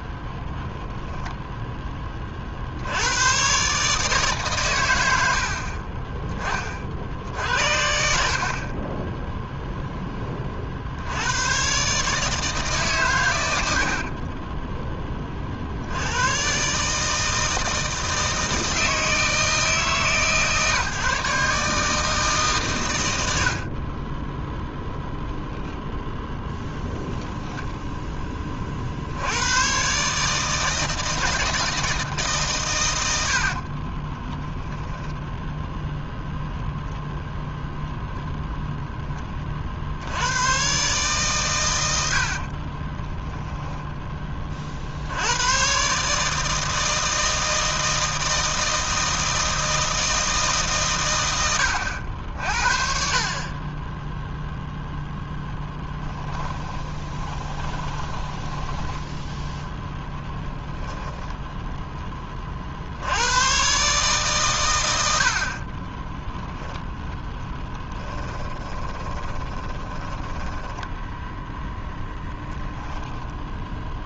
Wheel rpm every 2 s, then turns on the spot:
0, 90, 100, 40, 10, 60, 140, 10, 140, 160, 150, 120, 10, 0, 50, 160, 110, 10, 0, 10, 120, 20, 60, 160, 160, 130, 40, 0, 20, 10, 10, 60, 100, 10, 20, 10, 20.
34-36 42-44 56-62 68-72